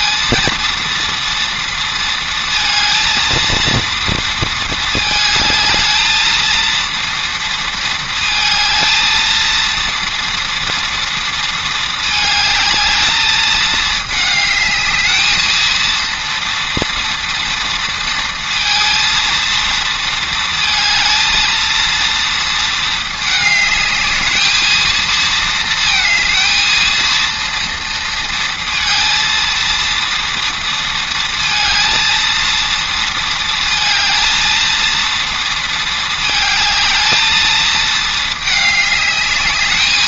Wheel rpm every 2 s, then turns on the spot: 230, 230, 220, 230, 220, 230, 220, 220, 230, 230, 220, 230, 220, 220, 230, 230, 230, 230, 220, 210.
none